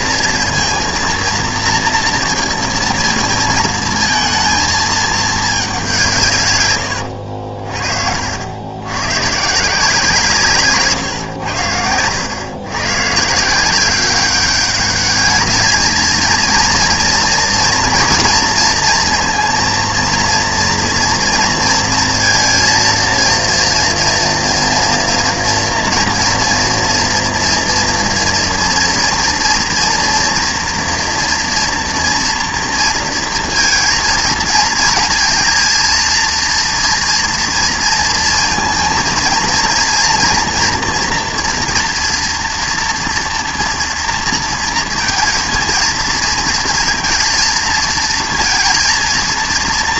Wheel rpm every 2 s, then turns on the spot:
230, 230, 220, 130, 90, 150, 120, 200, 230, 230, 230, 230, 240, 230, 230, 230, 230, 230, 230, 230, 230, 230, 230, 230, 230.
none